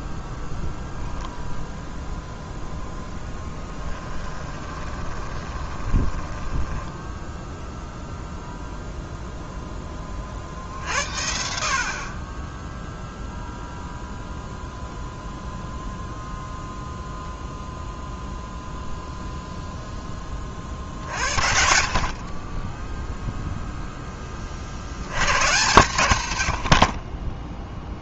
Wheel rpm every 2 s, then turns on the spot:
0, 0, 20, 10, 0, 50, 0, 0, 0, 0, 50, 10, 40, 60.
4-8